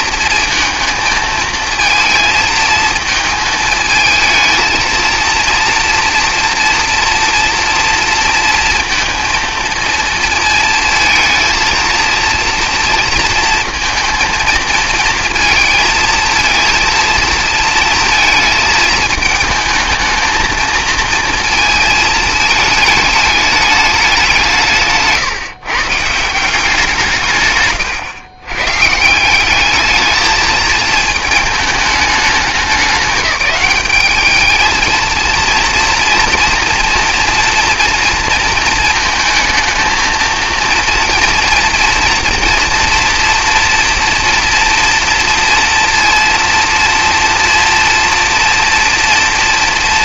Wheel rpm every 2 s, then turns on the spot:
220, 220, 230, 240, 230, 230, 230, 230, 230, 220, 220, 210, 160, 170, 130, 220, 190, 220, 230, 230, 230, 230, 230, 230, 230.
none